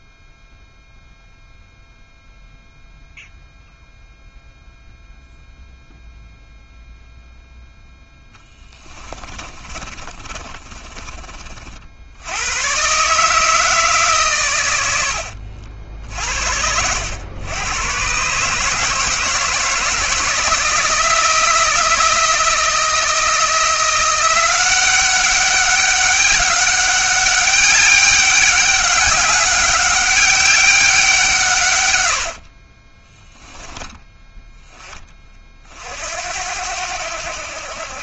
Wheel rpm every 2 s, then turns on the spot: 0, 0, 0, 0, 20, 40, 140, 90, 80, 160, 160, 170, 190, 200, 200, 190, 20, 10, 70.
8-12 32-34